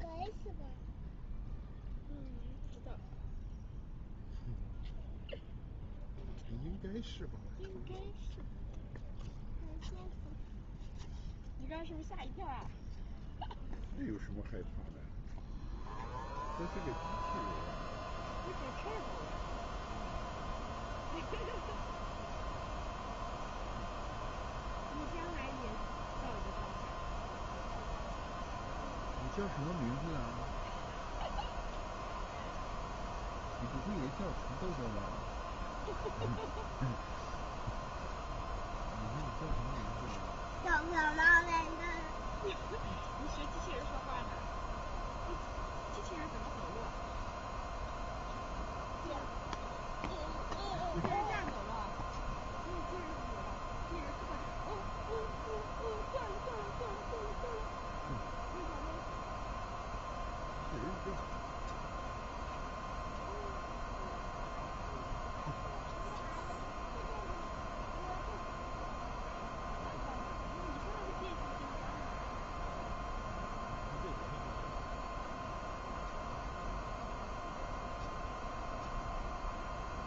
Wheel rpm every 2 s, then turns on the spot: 0, 0, 0, 0, 0, 0, 0, 0, 0, 0, 0, 0, 0, 0, 0, 0, 0, 0, 0, 0, 0, 0, 0, 0, 0, 0, 0, 0, 0, 0, 0, 0, 0, 0, 0, 0, 0, 0, 0, 0.
none